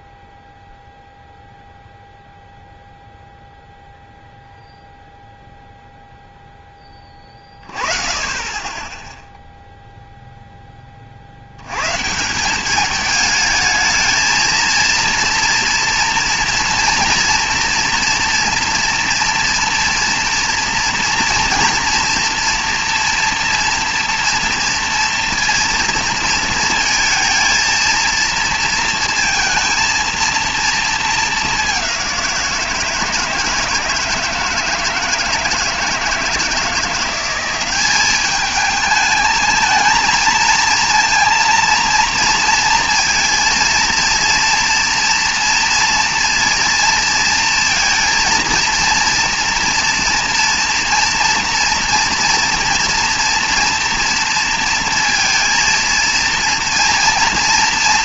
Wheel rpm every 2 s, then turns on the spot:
0, 0, 0, 10, 20, 10, 190, 230, 230, 230, 230, 230, 230, 220, 230, 230, 170, 160, 160, 210, 230, 230, 230, 230, 230, 230, 230, 230, 230.
none